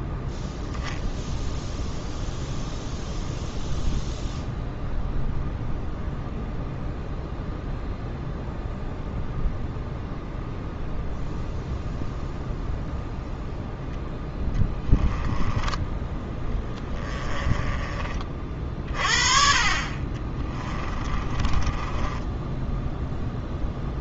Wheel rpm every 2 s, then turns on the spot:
0, 0, 0, 0, 0, 0, 0, 10, 10, 30, 30, 0.
14-18 20-22